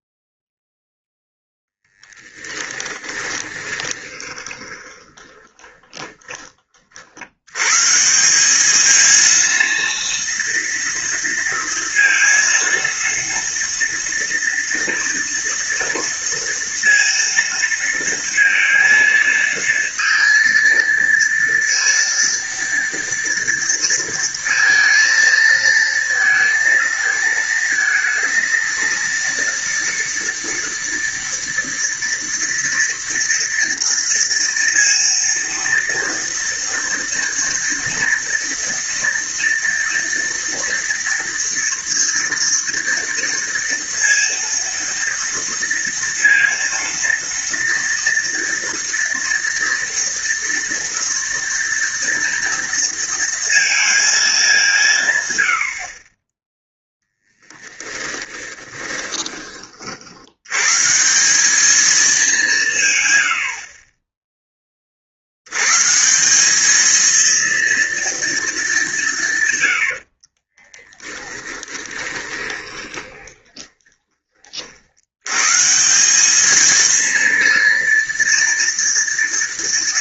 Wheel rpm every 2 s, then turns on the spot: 0, 10, 20, 40, 200, 230, 230, 230, 230, 230, 230, 230, 230, 220, 230, 230, 230, 230, 230, 230, 230, 230, 230, 230, 230, 230, 230, 200, 10, 10, 130, 170, 30, 210, 210, 20, 10, 50, 220, 230.
2-6 58-60 70-74